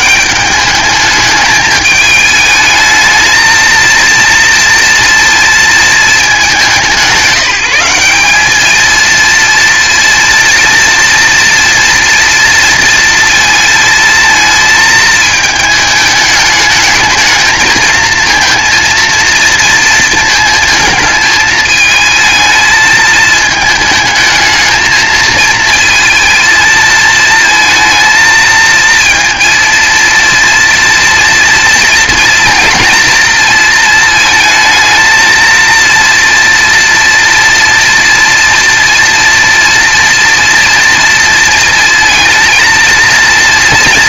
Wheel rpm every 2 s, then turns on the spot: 210, 220, 230, 180, 220, 240, 230, 220, 220, 230, 220, 220, 220, 220, 220, 230, 230, 220, 230, 230, 230, 230.
none